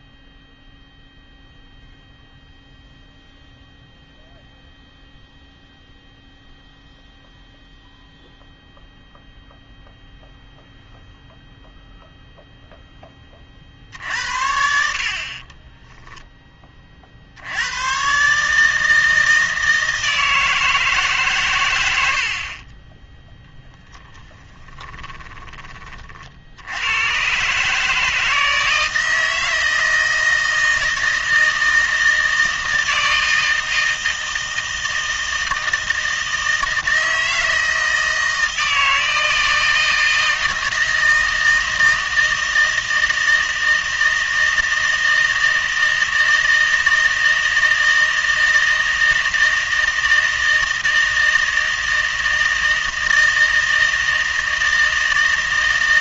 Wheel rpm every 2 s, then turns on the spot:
0, 0, 0, 0, 0, 0, 0, 70, 20, 150, 160, 30, 20, 80, 160, 160, 160, 160, 160, 160, 160, 160, 160, 160, 160, 160, 160, 160.
24-26